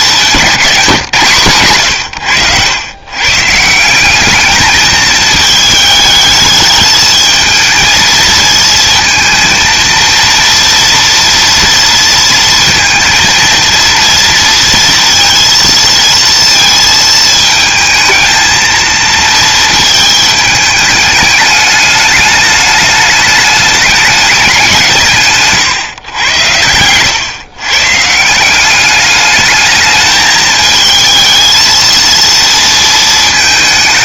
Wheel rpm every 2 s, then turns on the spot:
150, 120, 220, 220, 220, 230, 230, 230, 220, 220, 210, 210, 160, 110, 210, 220, 220.
none